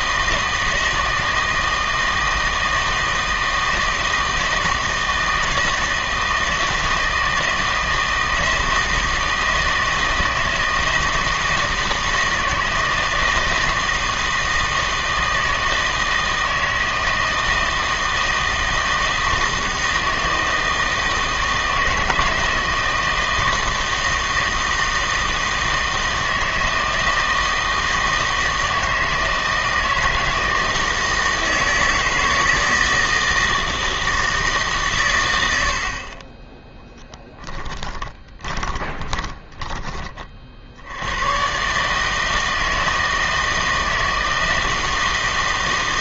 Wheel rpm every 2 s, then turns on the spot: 160, 160, 160, 160, 160, 160, 160, 160, 160, 160, 160, 160, 160, 160, 160, 160, 160, 140, 10, 20, 70, 160, 160.
38-40